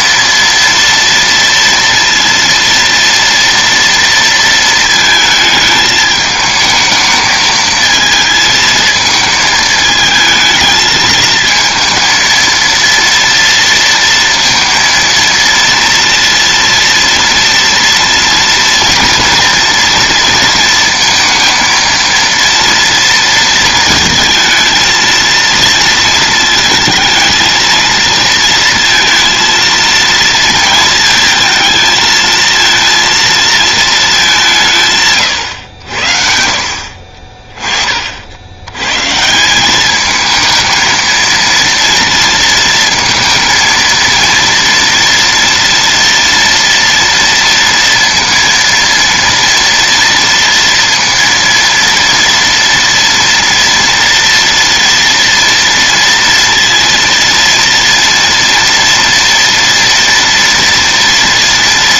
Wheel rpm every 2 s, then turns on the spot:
230, 230, 230, 220, 220, 220, 230, 230, 230, 230, 230, 230, 220, 230, 230, 230, 220, 200, 60, 70, 220, 230, 230, 230, 230, 230, 230, 230, 230, 230, 230.
none